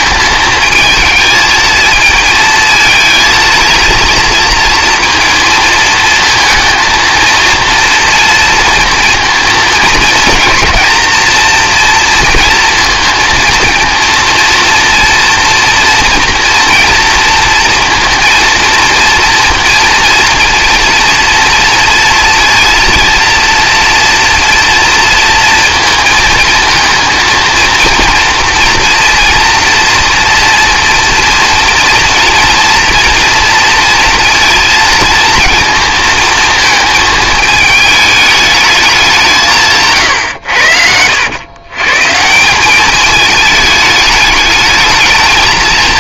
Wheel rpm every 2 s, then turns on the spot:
220, 220, 230, 230, 230, 230, 230, 230, 230, 230, 230, 230, 230, 220, 230, 240, 230, 220, 230, 200, 80, 210, 220.
40-42